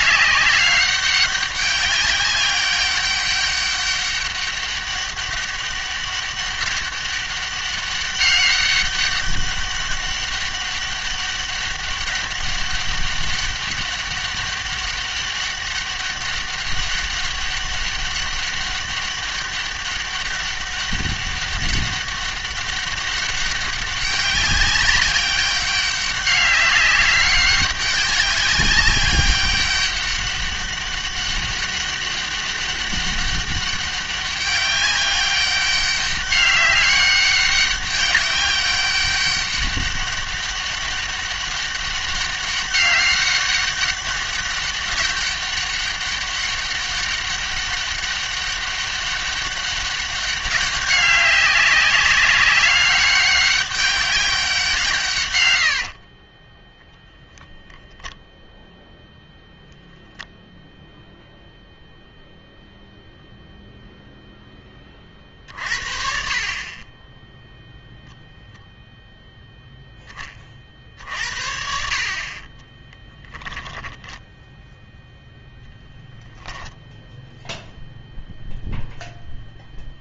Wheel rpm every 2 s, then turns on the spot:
200, 200, 200, 200, 200, 200, 200, 200, 200, 200, 200, 200, 200, 200, 200, 200, 200, 200, 200, 200, 200, 200, 200, 200, 200, 200, 200, 160, 0, 0, 0, 0, 30, 30, 0, 60, 10, 0, 0, 0.
72-74